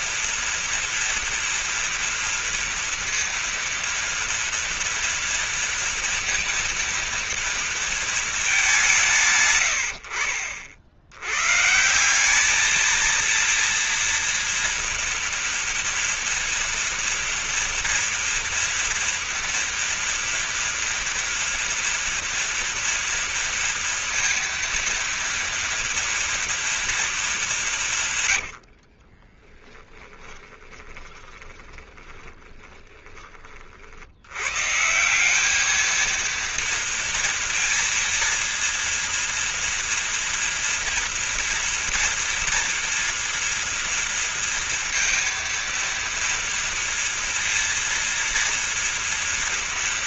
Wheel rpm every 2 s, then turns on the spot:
230, 230, 230, 230, 190, 70, 220, 240, 240, 230, 230, 230, 230, 230, 50, 20, 10, 140, 230, 230, 230, 240, 230, 230, 230.
28-34